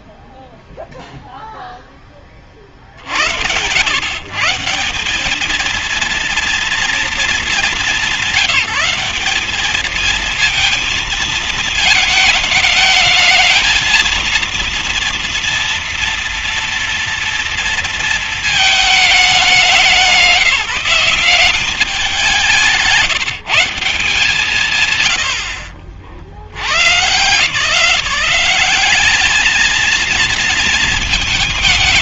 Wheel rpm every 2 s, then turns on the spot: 0, 40, 150, 230, 190, 220, 220, 230, 230, 220, 180, 170, 120, 120, 190, 220.
none